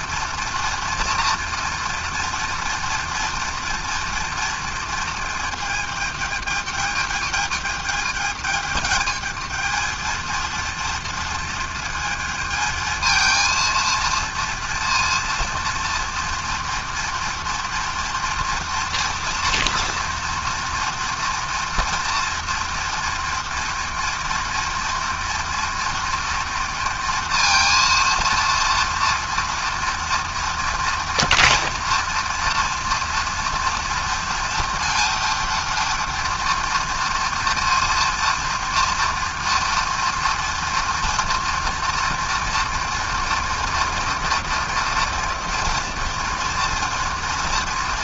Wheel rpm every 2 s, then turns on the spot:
230, 230, 230, 210, 220, 230, 220, 230, 230, 240, 240, 230, 230, 230, 230, 230, 230, 230, 230, 230, 230, 230, 230, 230.
none